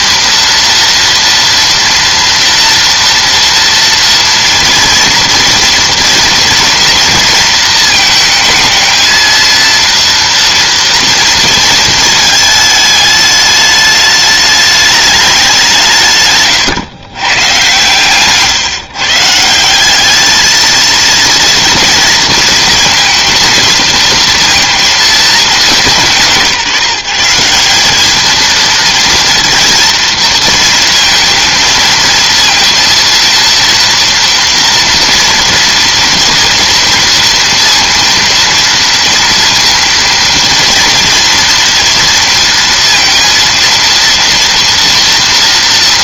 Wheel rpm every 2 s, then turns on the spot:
230, 240, 230, 230, 220, 230, 210, 210, 130, 150, 230, 220, 230, 160, 220, 220, 230, 230, 230, 230, 230, 230, 230.
none